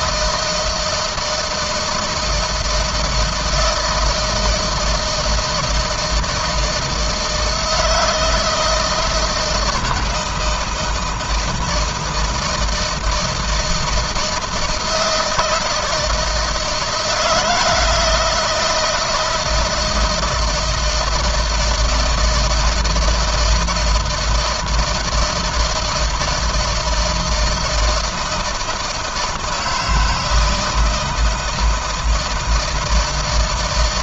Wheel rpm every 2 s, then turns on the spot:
160, 160, 160, 160, 160, 160, 160, 160, 170, 170, 160, 160, 160, 160, 160, 160, 160.
none